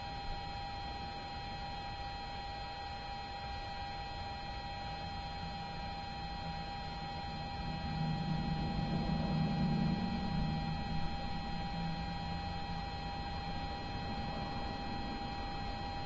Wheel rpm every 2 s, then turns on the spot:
0, 0, 0, 0, 0, 0, 0, 0.
none